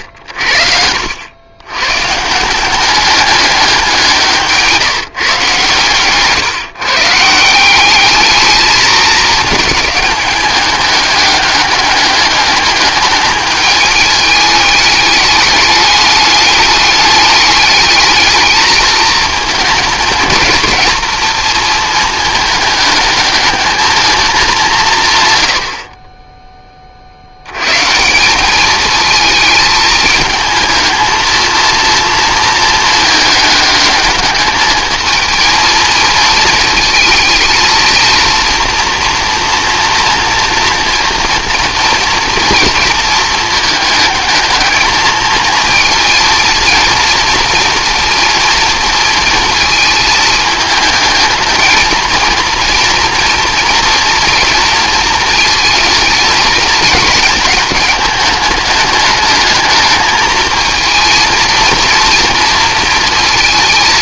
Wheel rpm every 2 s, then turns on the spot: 70, 180, 160, 140, 220, 210, 210, 210, 200, 220, 230, 220, 160, 20, 210, 220, 220, 220, 220, 230, 240, 220, 220, 230, 230, 220, 230, 230, 220, 210, 220, 230.
none